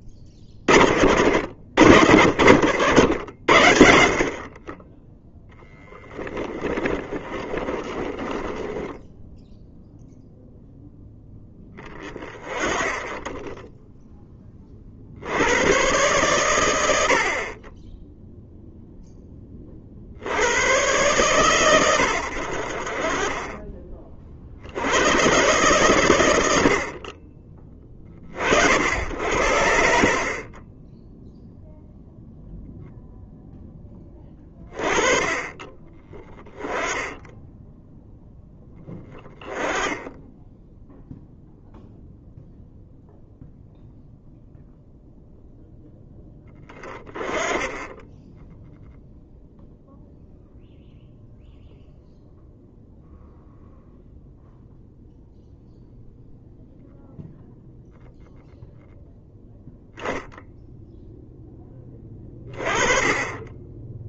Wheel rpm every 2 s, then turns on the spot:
50, 50, 20, 20, 10, 0, 30, 50, 90, 0, 110, 50, 90, 30, 70, 20, 0, 20, 10, 10, 0, 0, 0, 10, 10, 0, 0, 0, 0, 0, 0, 30.
6-10